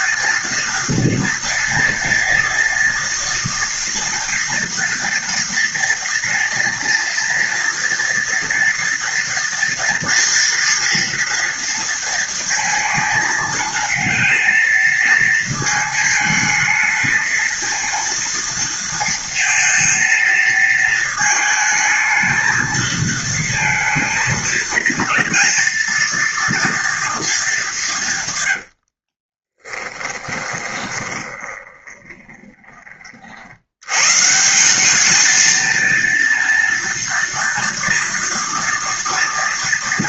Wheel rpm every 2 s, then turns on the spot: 230, 230, 230, 230, 230, 230, 230, 220, 220, 230, 220, 220, 230, 230, 140, 20, 20, 130, 230, 230.
30-34